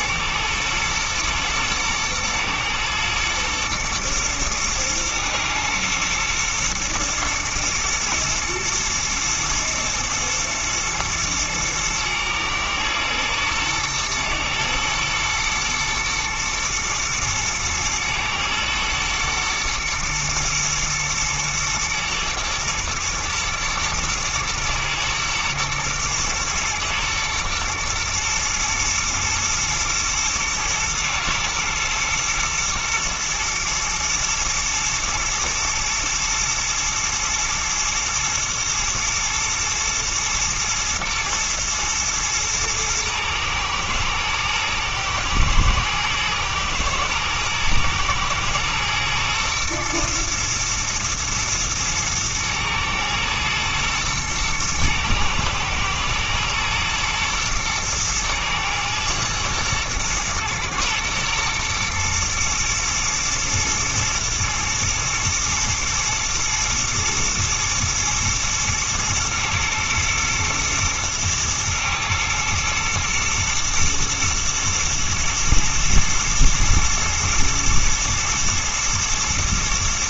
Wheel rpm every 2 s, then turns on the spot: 110, 120, 120, 120, 110, 110, 110, 110, 120, 110, 110, 120, 110, 110, 110, 110, 110, 110, 110, 120, 120, 110, 110, 110, 110, 120, 110, 110, 120, 110, 110, 110, 110, 110, 110, 110, 110, 110, 110, 110.
none